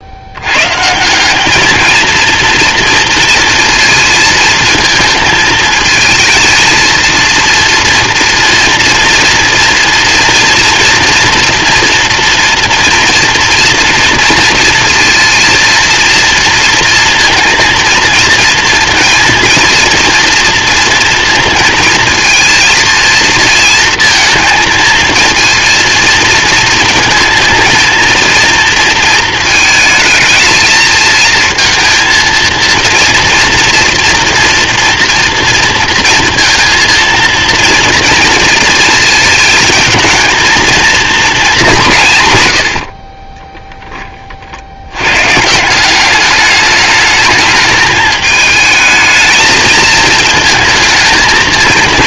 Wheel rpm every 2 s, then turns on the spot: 120, 230, 220, 230, 230, 230, 230, 230, 230, 230, 230, 230, 230, 220, 230, 220, 230, 230, 230, 230, 230, 100, 60, 210, 210, 220.
none